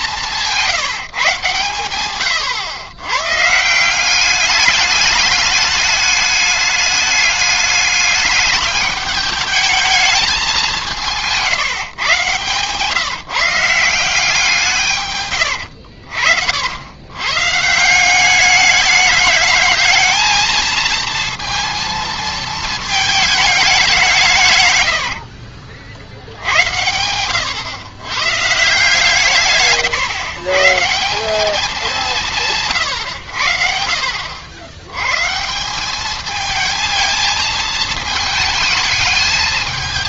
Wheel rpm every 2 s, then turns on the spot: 170, 110, 200, 210, 210, 200, 150, 160, 70, 200, 220, 220, 120, 80, 140, 140, 140, 90, 220, 210.
none